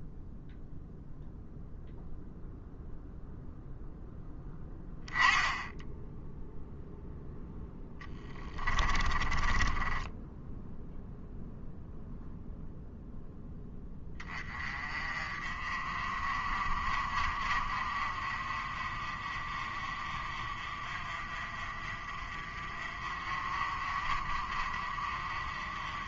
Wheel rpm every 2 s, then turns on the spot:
0, 0, 10, 0, 20, 0, 0, 30, 40, 40, 40, 40, 40.
8-10